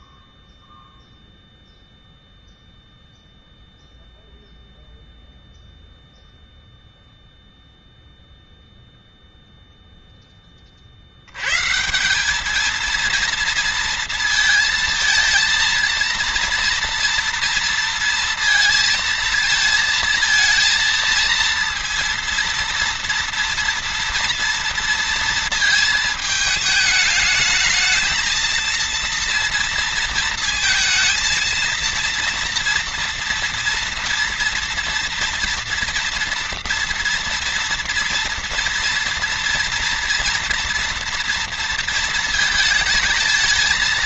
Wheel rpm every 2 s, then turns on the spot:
0, 0, 0, 0, 0, 20, 210, 230, 230, 230, 230, 230, 230, 220, 220, 230, 230, 230, 230, 230, 230, 230.
none